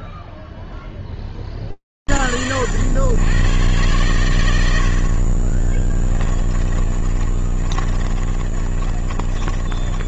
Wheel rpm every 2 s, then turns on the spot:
0, 90, 110, 20, 40.
6-10